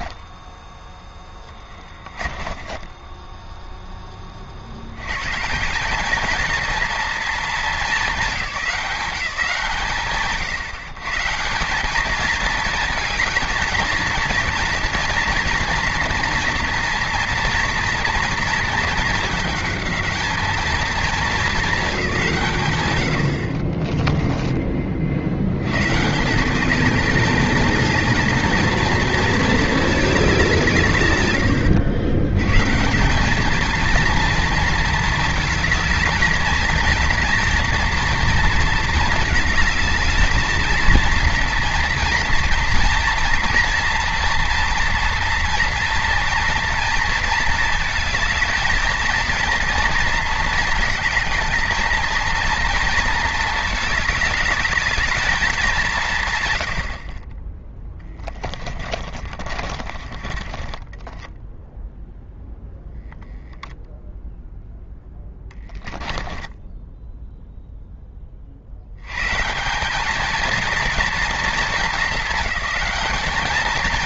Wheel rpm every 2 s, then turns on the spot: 10, 20, 80, 230, 170, 130, 220, 230, 230, 220, 210, 90, 30, 200, 220, 150, 160, 230, 230, 230, 220, 240, 230, 230, 220, 230, 230, 220, 70, 30, 10, 0, 10, 10, 70, 230, 200.
2-4 58-62 66-68